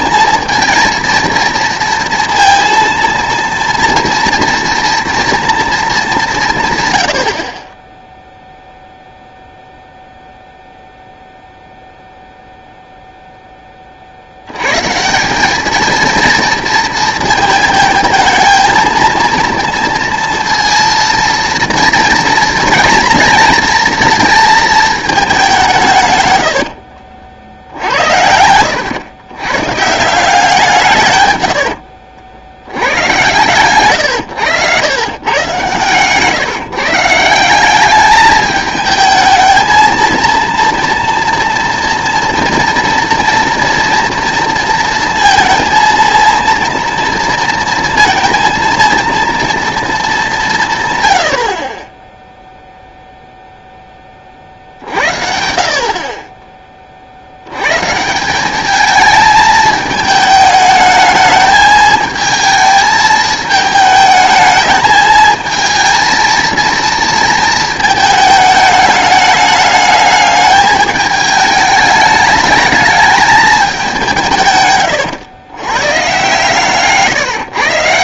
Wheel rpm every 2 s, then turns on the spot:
230, 230, 230, 120, 0, 0, 0, 120, 220, 220, 230, 230, 220, 80, 100, 170, 90, 110, 150, 220, 230, 230, 230, 230, 230, 160, 0, 50, 20, 210, 220, 220, 220, 230, 210, 210, 210, 130, 140.
26-28 74-76